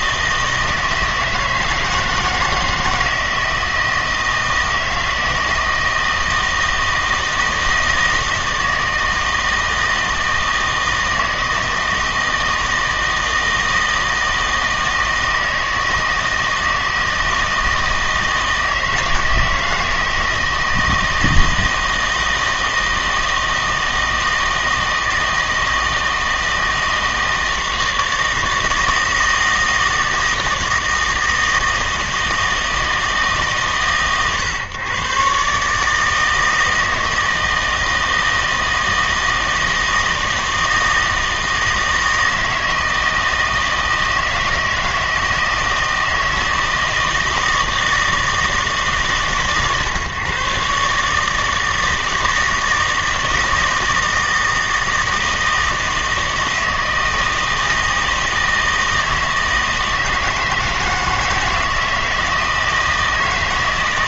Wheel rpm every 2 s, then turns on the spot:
160, 160, 160, 160, 160, 160, 160, 160, 160, 160, 160, 160, 160, 160, 160, 160, 160, 130, 160, 160, 160, 160, 160, 160, 160, 140, 160, 160, 160, 160, 160, 160.
none